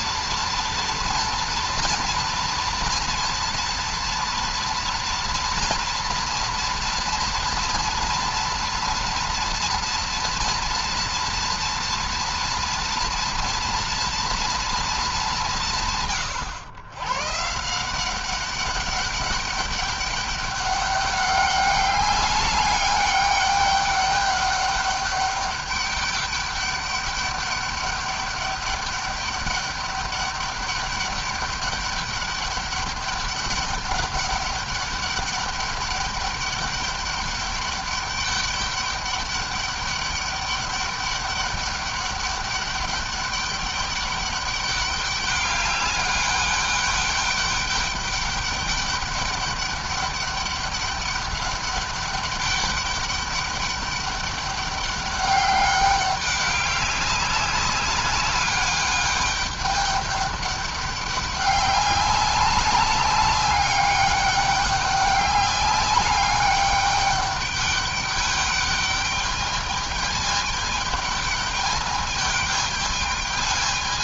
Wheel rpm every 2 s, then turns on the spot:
230, 230, 230, 230, 240, 230, 240, 220, 110, 200, 200, 200, 200, 200, 200, 200, 200, 200, 200, 200, 200, 200, 200, 200, 200, 200, 200, 200, 200, 200, 200, 200, 200, 200, 200, 210, 210.
none